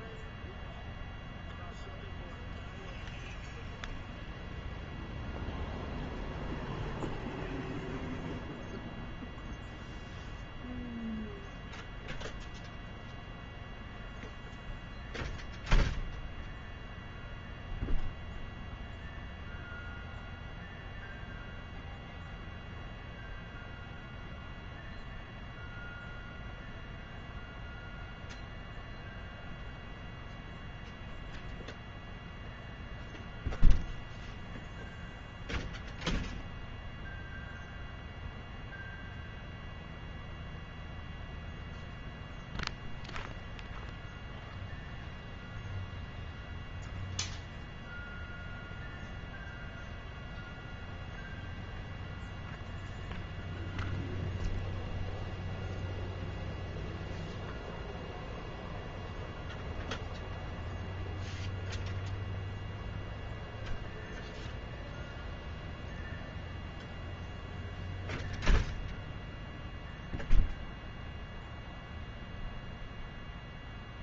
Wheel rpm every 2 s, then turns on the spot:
0, 0, 0, 0, 0, 0, 0, 0, 0, 0, 0, 0, 0, 0, 0, 0, 0, 0, 0, 0, 0, 0, 0, 0, 0, 0, 0, 0, 0, 0, 0, 0, 0, 0, 0, 0, 0.
none